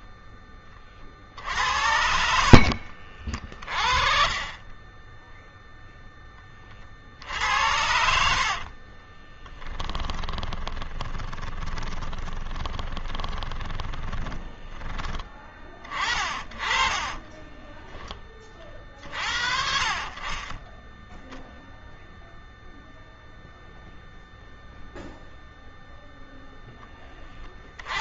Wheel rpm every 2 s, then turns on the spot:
20, 60, 30, 10, 60, 10, 20, 10, 30, 30, 30, 0, 0, 0.
2-4 8-18